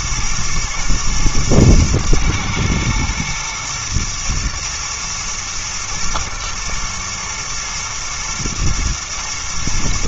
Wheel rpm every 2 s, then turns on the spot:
110, 120, 120, 110, 110.
none